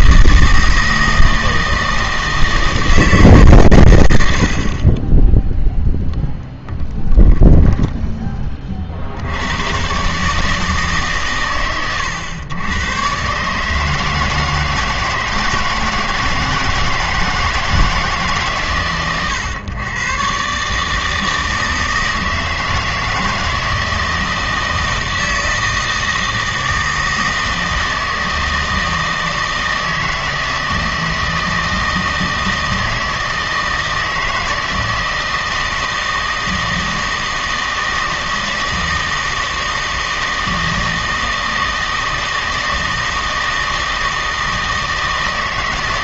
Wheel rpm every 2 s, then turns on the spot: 160, 160, 60, 10, 30, 150, 110, 160, 160, 130, 140, 160, 160, 160, 160, 160, 160, 160, 160, 160, 160, 160, 160.
6-8